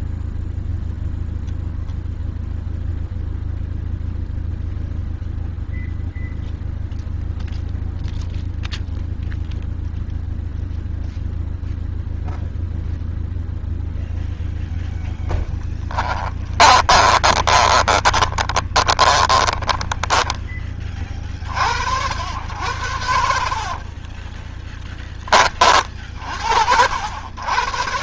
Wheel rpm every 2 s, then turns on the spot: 0, 0, 0, 0, 0, 0, 0, 0, 10, 20, 10, 60, 50, 50.
16-20 24-26